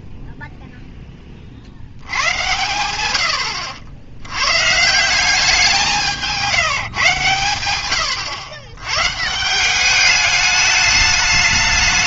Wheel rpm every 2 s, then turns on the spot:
0, 100, 130, 170, 110, 200.
none